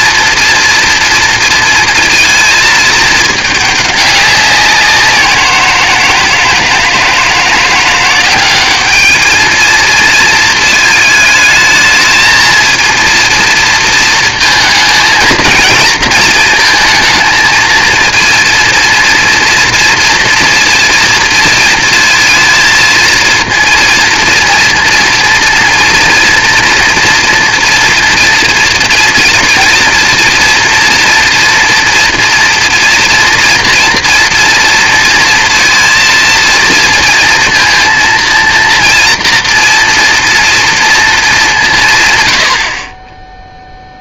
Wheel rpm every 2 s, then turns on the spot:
230, 220, 190, 160, 190, 220, 230, 220, 220, 230, 230, 230, 230, 230, 230, 230, 230, 230, 230, 230, 230, 150.
none